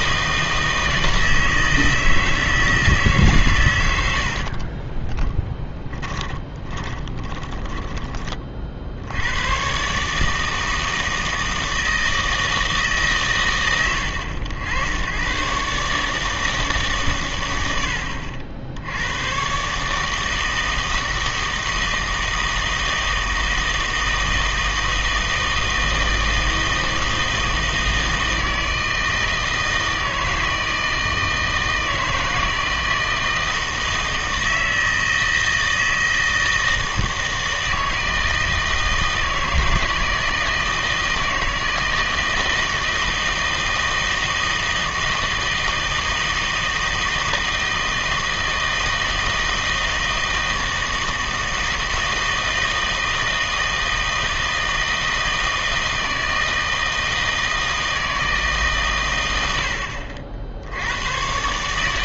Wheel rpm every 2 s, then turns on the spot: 160, 160, 40, 20, 50, 160, 160, 90, 150, 80, 160, 160, 160, 160, 160, 160, 160, 160, 160, 160, 160, 160, 160, 160, 160, 160, 160, 160, 160, 140, 80.
4-8